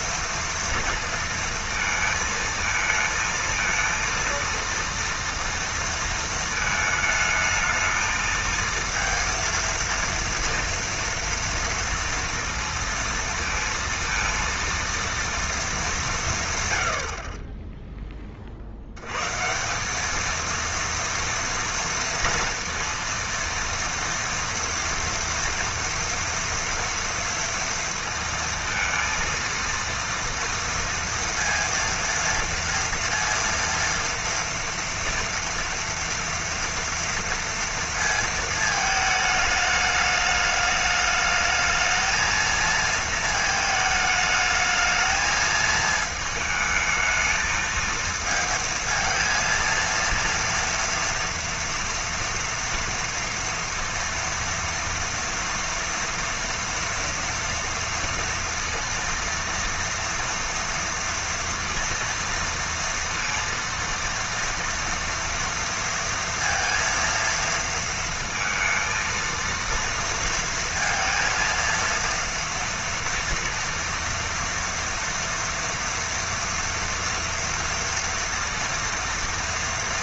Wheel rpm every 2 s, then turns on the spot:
230, 220, 230, 220, 230, 230, 230, 230, 110, 60, 230, 230, 230, 230, 230, 230, 230, 230, 230, 220, 210, 230, 220, 220, 230, 230, 230, 230, 230, 230, 240, 230, 230, 230, 230, 230, 230, 230, 230, 230.
none